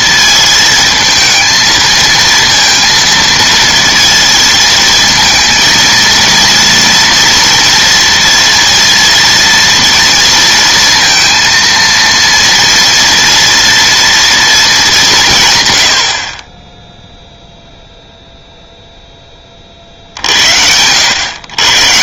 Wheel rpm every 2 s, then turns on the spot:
220, 230, 230, 230, 230, 230, 230, 200, 10, 0, 80.
none